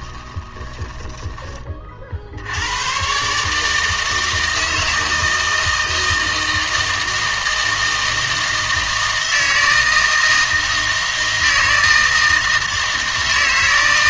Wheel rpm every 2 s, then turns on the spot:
20, 100, 160, 160, 160, 160, 160.
0-2